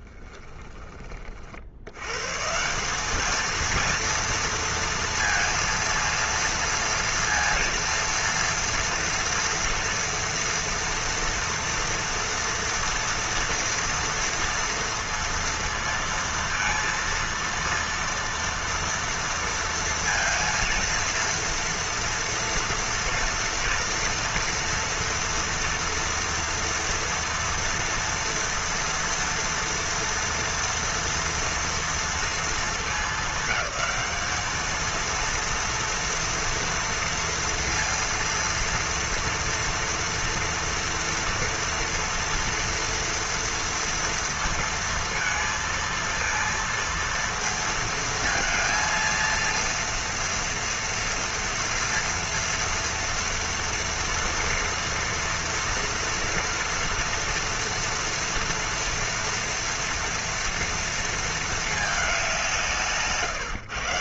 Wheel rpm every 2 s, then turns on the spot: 20, 170, 230, 230, 230, 230, 240, 230, 230, 230, 230, 230, 240, 230, 230, 230, 220, 220, 230, 230, 240, 230, 230, 230, 230, 230, 230, 240, 230, 240, 230, 170.
0-2